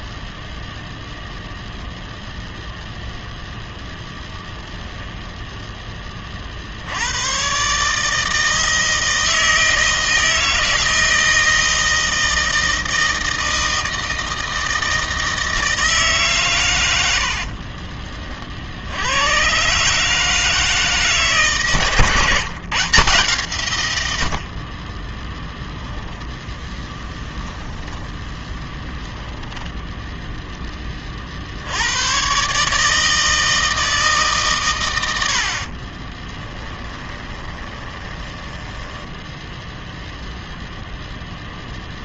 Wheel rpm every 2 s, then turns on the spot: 0, 0, 10, 70, 160, 160, 160, 160, 100, 70, 160, 150, 30, 10, 10, 10, 150, 110, 20, 10, 0.
26-30 36-40